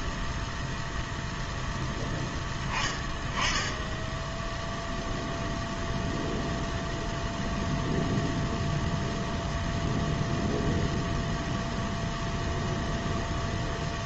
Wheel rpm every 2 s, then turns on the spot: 0, 10, 0, 0, 0, 0, 0.
none